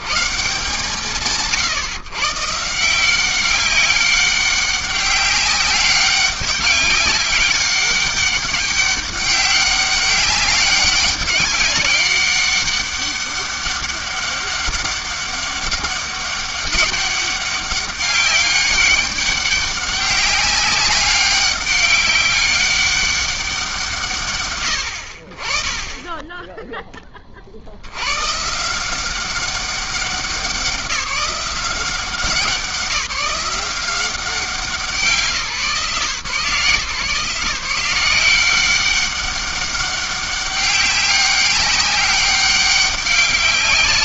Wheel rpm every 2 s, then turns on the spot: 140, 190, 200, 190, 200, 200, 200, 190, 200, 190, 200, 160, 20, 80, 190, 190, 180, 150, 160, 200, 200, 200.
none